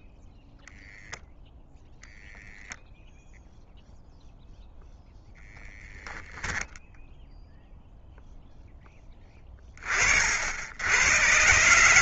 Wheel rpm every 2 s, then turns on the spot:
0, 0, 0, 0, 90, 130.
none